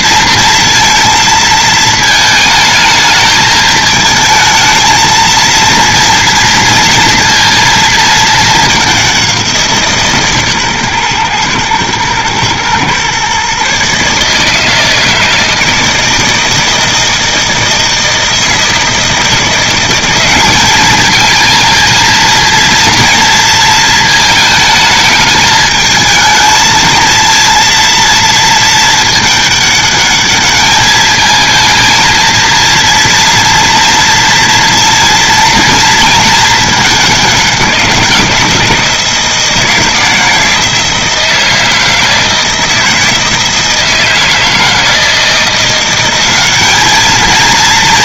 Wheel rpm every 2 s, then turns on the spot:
230, 220, 220, 230, 200, 130, 120, 160, 160, 160, 210, 230, 220, 220, 220, 210, 230, 230, 200, 160, 160, 160, 160, 210.
none